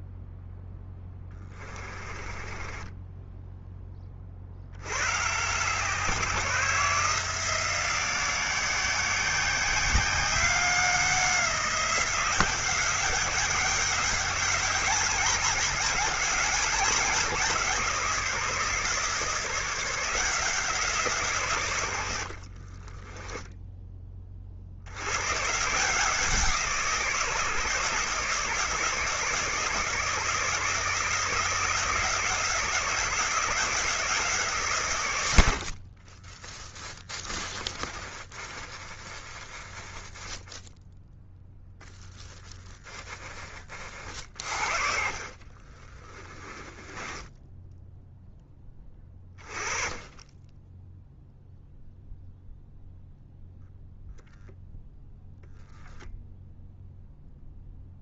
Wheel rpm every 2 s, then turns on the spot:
10, 20, 80, 160, 180, 190, 190, 200, 190, 150, 160, 30, 90, 160, 160, 160, 170, 130, 20, 20, 0, 10, 60, 20, 10, 0, 0, 0, 0.
0-4 22-24 36-40 44-48